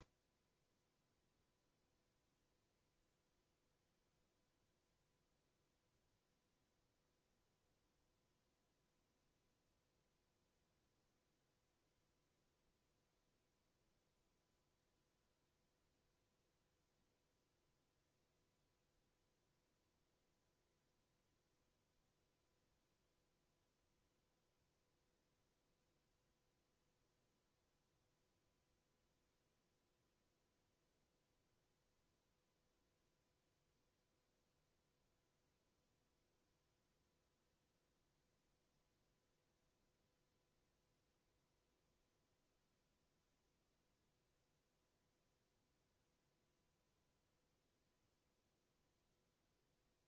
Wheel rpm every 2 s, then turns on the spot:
0, 0, 0, 0, 0, 0, 0, 0, 0, 0, 0, 0, 0, 0, 0, 0, 0, 0, 0, 0, 0, 0, 0, 0, 0.
none